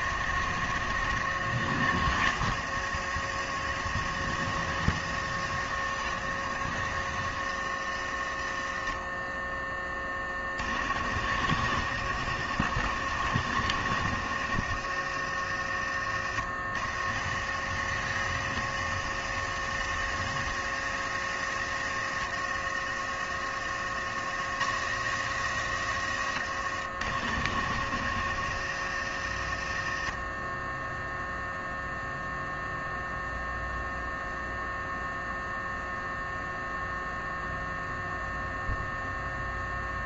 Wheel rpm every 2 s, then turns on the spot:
70, 70, 70, 70, 20, 60, 70, 50, 50, 60, 60, 50, 80, 60, 50, 0, 0, 0, 0, 0.
none